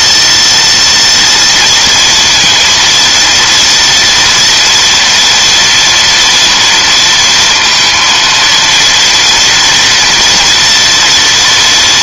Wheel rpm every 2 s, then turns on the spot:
230, 230, 240, 230, 230, 240.
none